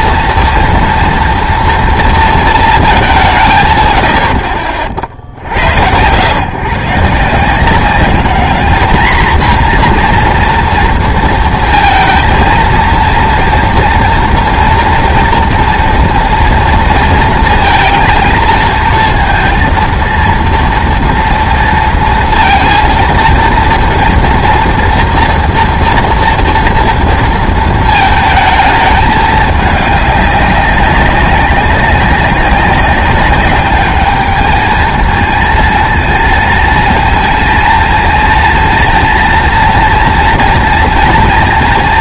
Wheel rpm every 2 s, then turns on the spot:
230, 220, 60, 110, 220, 240, 230, 230, 230, 220, 230, 230, 230, 230, 210, 190, 190, 220, 230, 230, 230.
none